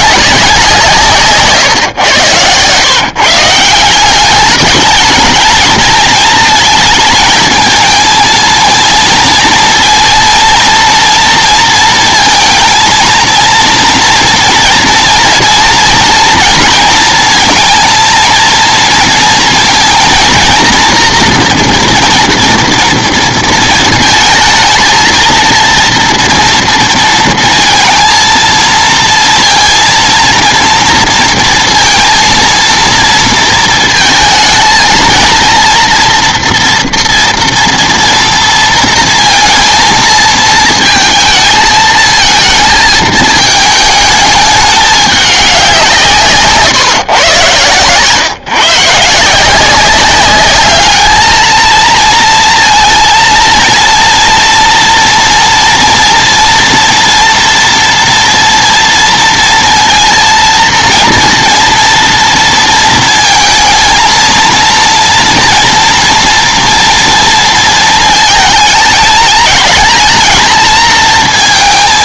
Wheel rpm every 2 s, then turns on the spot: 160, 120, 210, 220, 230, 230, 230, 230, 230, 230, 230, 230, 230, 230, 230, 240, 230, 230, 240, 230, 230, 220, 210, 140, 150, 210, 230, 230, 230, 230, 230, 230, 230, 230, 210, 220.
none